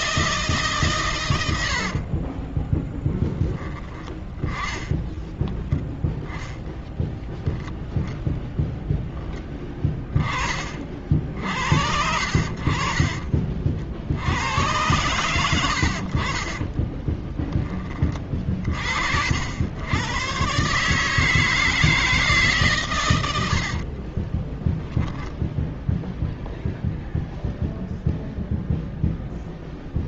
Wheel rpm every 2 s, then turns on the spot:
150, 30, 10, 10, 0, 40, 50, 80, 50, 30, 130, 150, 20, 0, 0.
2-6 24-26